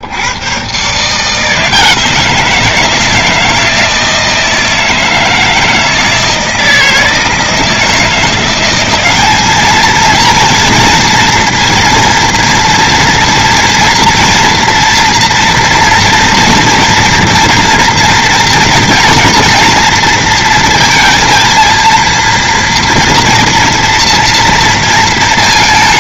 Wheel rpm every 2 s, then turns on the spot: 120, 160, 160, 160, 180, 230, 230, 230, 240, 230, 230, 230, 230.
none